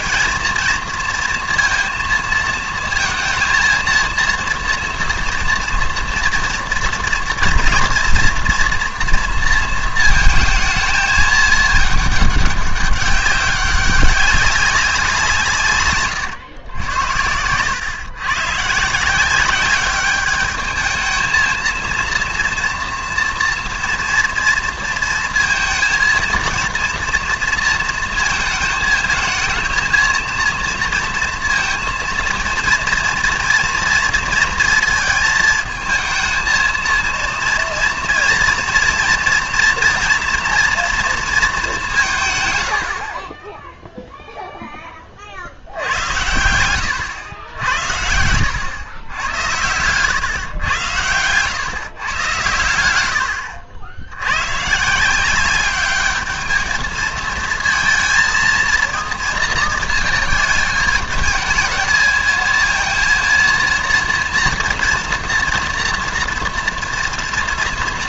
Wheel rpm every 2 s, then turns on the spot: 230, 220, 230, 230, 240, 220, 200, 190, 110, 140, 210, 230, 230, 230, 220, 230, 230, 230, 230, 230, 230, 110, 10, 90, 100, 120, 110, 110, 210, 230, 220, 220, 230, 230.
none